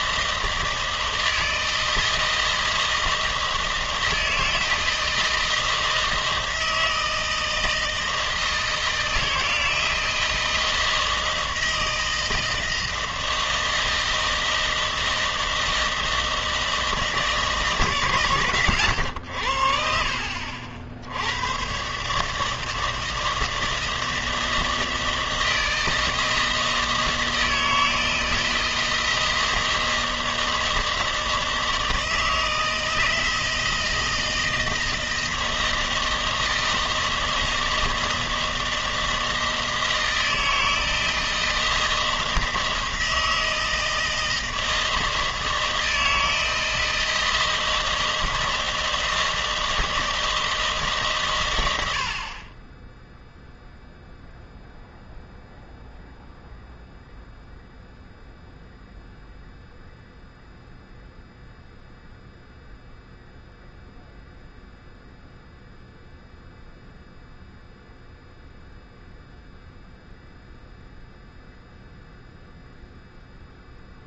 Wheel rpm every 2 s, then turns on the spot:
160, 160, 160, 160, 160, 160, 160, 160, 160, 130, 60, 140, 160, 160, 160, 160, 160, 160, 160, 160, 160, 160, 160, 160, 160, 160, 30, 0, 0, 0, 0, 0, 0, 0, 0, 0, 0.
none